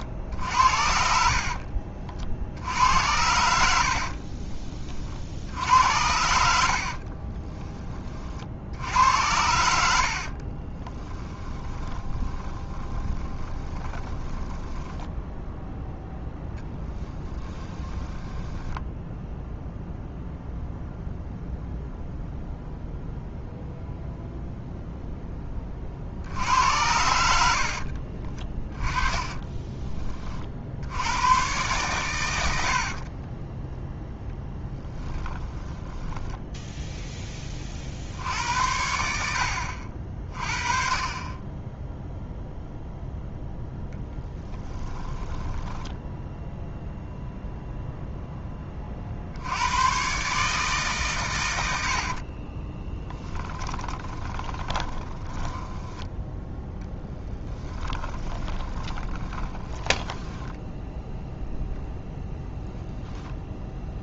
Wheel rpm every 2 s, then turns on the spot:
60, 80, 30, 60, 70, 20, 20, 20, 10, 10, 0, 0, 0, 80, 10, 80, 50, 10, 10, 80, 40, 0, 10, 0, 40, 140, 10, 10, 10, 20, 10, 10.
0-2 6-8 10-14 16-20 26-30 32-36 44-46 52-60